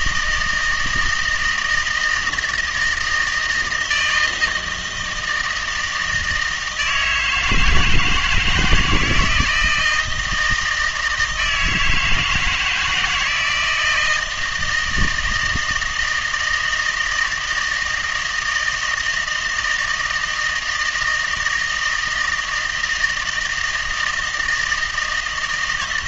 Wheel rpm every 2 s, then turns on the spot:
160, 160, 160, 160, 160, 160, 170, 160, 160, 160, 160, 160, 160.
none